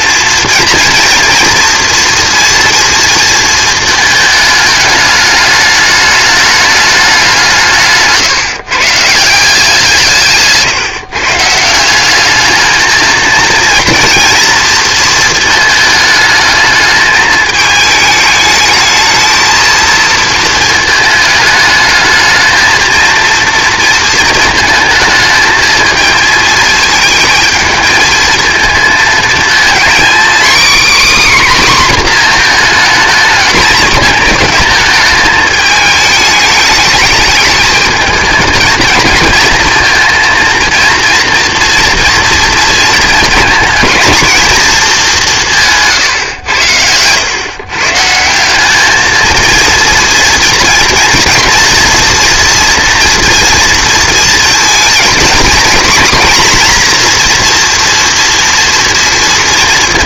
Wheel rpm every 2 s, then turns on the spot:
230, 230, 220, 210, 140, 150, 220, 230, 210, 220, 220, 230, 220, 220, 220, 260, 230, 220, 210, 230, 230, 230, 220, 100, 200, 230, 240, 230, 240, 230.
46-48